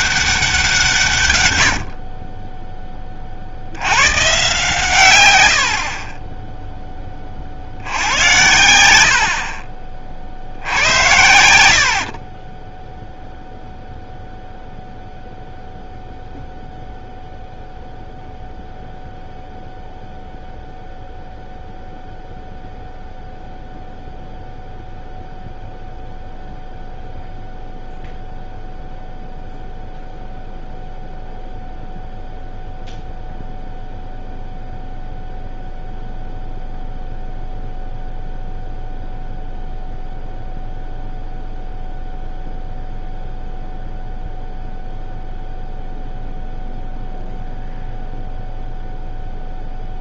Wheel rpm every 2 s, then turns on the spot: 180, 30, 130, 10, 80, 60, 10, 0, 0, 0, 0, 0, 0, 0, 0, 0, 0, 0, 0, 0, 0, 0, 0, 0, 0.
none